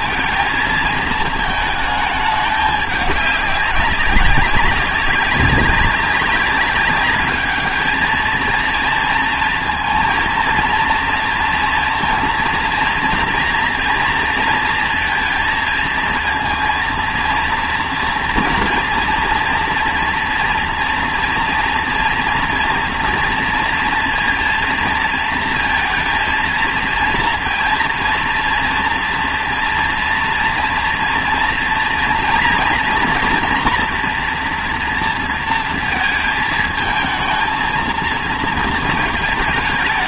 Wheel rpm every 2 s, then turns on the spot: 230, 210, 200, 200, 230, 230, 230, 230, 230, 230, 230, 240, 230, 230, 230, 230, 230, 240, 220, 220.
none